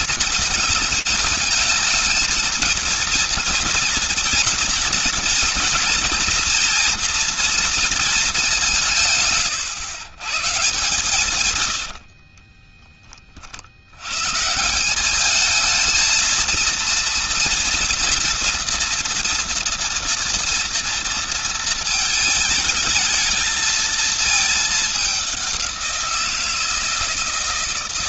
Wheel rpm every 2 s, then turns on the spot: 230, 220, 230, 240, 190, 140, 30, 180, 230, 230, 230, 220, 210, 160.
12-14